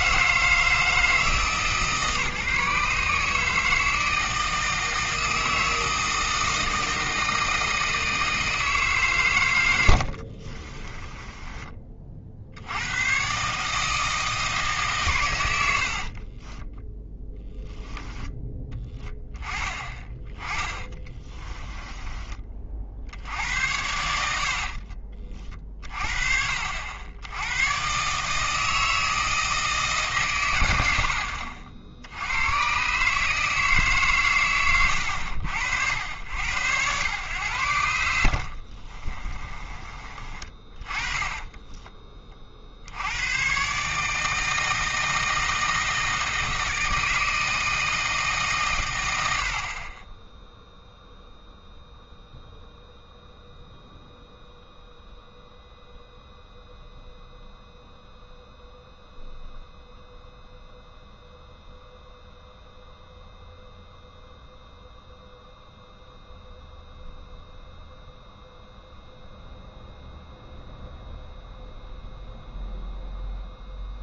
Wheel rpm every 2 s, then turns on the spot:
160, 150, 160, 160, 150, 30, 100, 140, 10, 10, 20, 50, 50, 70, 160, 80, 130, 100, 100, 30, 30, 70, 160, 160, 100, 0, 0, 0, 0, 0, 0, 0, 0, 0, 0, 0, 0.
10-12 16-18 20-22 24-26 38-42